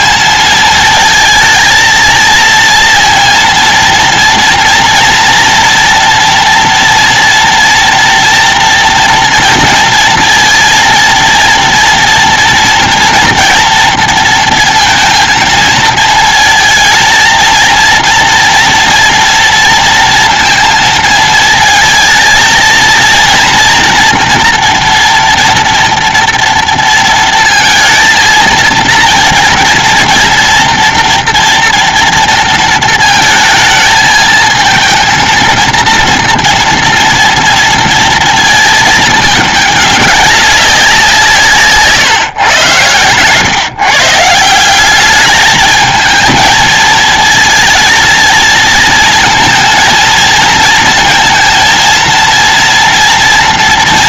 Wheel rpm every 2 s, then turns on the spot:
220, 230, 230, 240, 230, 230, 230, 230, 230, 230, 230, 230, 230, 230, 230, 230, 220, 230, 230, 220, 170, 100, 200, 220, 230, 230, 230.
none